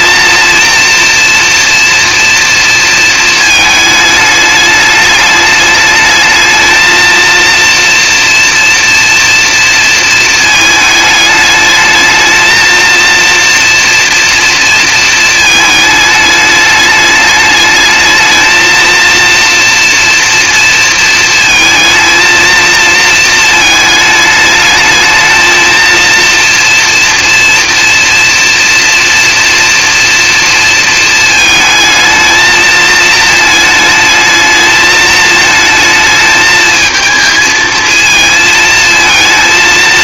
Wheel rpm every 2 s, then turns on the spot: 230, 230, 210, 220, 230, 220, 220, 230, 210, 220, 230, 230, 210, 230, 230, 230, 220, 220, 220, 230.
none